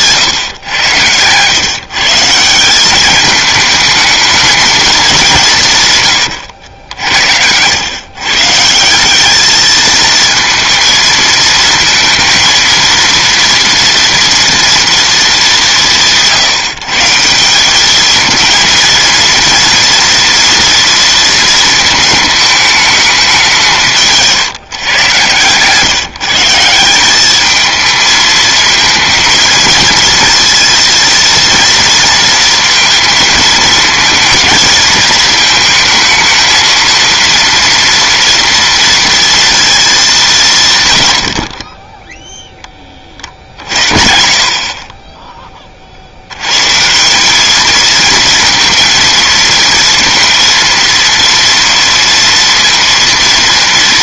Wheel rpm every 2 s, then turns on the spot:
120, 180, 220, 80, 150, 220, 230, 230, 150, 220, 240, 220, 160, 160, 220, 230, 230, 230, 220, 230, 180, 10, 30, 110, 230, 230, 230.
6-8